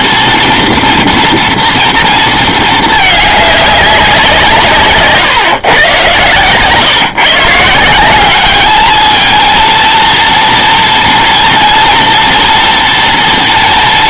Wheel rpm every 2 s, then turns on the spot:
230, 220, 160, 130, 210, 230, 230.
none